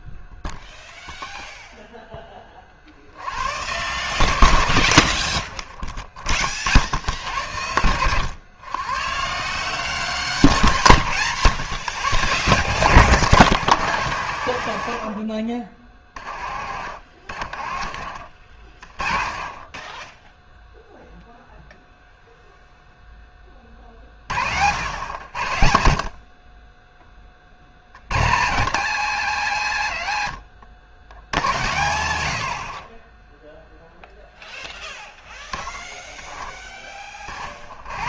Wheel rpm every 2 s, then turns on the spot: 0, 100, 60, 90, 160, 120, 140, 40, 40, 30, 0, 10, 80, 20, 120, 90, 20, 10, 30.
16-18